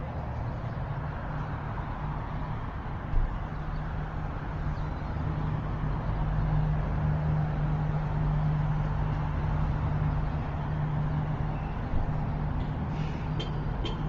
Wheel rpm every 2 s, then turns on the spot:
0, 0, 0, 0, 0, 0, 0.
none